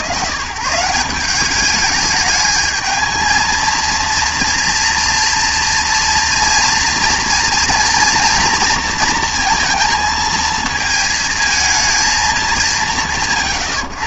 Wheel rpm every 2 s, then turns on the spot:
160, 220, 230, 230, 230, 230, 110.
none